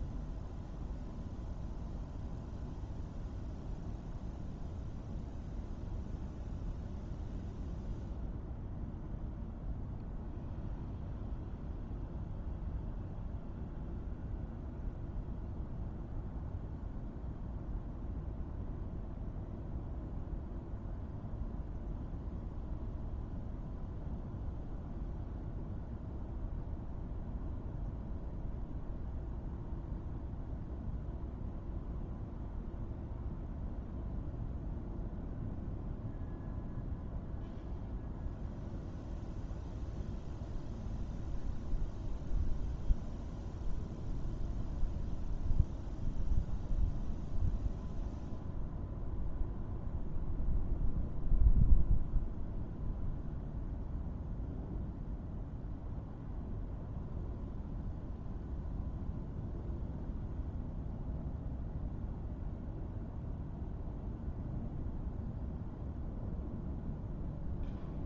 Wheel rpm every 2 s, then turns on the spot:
0, 0, 0, 0, 0, 0, 0, 0, 0, 0, 0, 0, 0, 0, 0, 0, 0, 0, 0, 0, 0, 0, 0, 0, 0, 0, 0, 0, 0, 0, 0, 0, 0, 0.
none